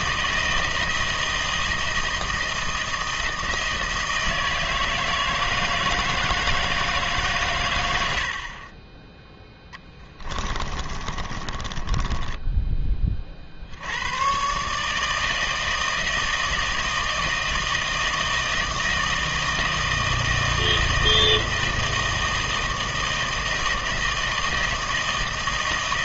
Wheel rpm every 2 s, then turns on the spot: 160, 160, 160, 160, 40, 20, 10, 130, 160, 160, 160, 160, 160.
10-12